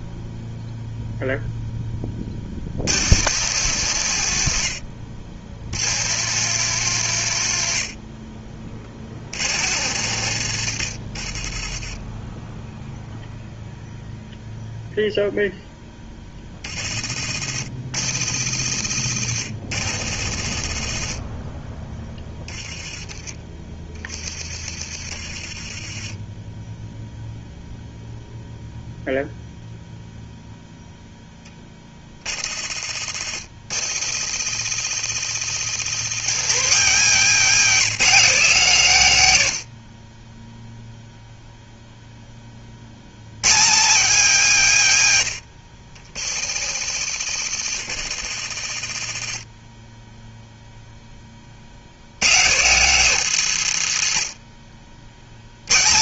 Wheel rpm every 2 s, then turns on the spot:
0, 100, 60, 130, 50, 60, 0, 0, 50, 80, 40, 20, 30, 0, 0, 0, 60, 100, 220, 170, 0, 100, 160, 80, 50, 20, 180, 80.
48-50